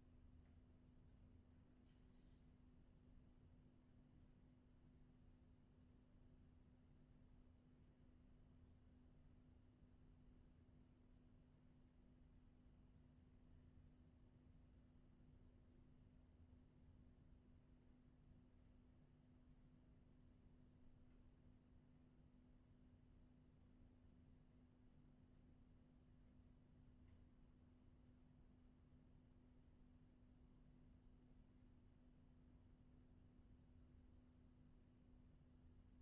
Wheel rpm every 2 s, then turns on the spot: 0, 0, 0, 0, 0, 0, 0, 0, 0, 0, 0, 0, 0, 0, 0, 0, 0, 0.
none